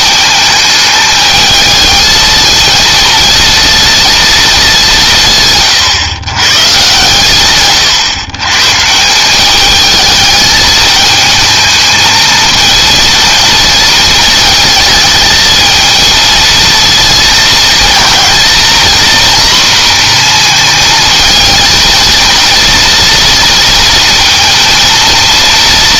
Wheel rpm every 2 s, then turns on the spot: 220, 230, 180, 140, 150, 220, 230, 220, 220, 230, 230, 230, 230.
none